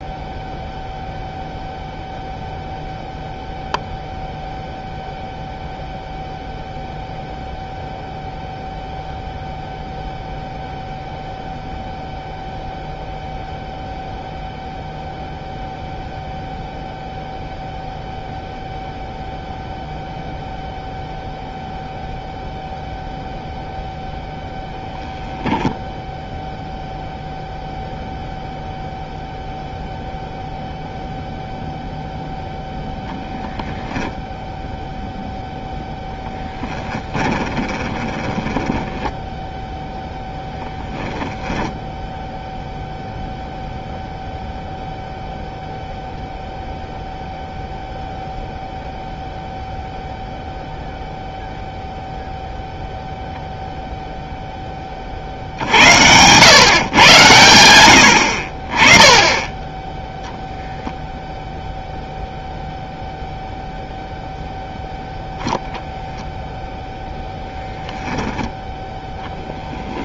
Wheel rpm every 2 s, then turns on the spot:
0, 0, 0, 0, 0, 0, 0, 0, 0, 0, 0, 0, 0, 0, 0, 0, 0, 0, 20, 10, 0, 0, 0, 0, 0, 0, 0, 30, 120, 30, 0, 0, 0, 0, 10.
36-40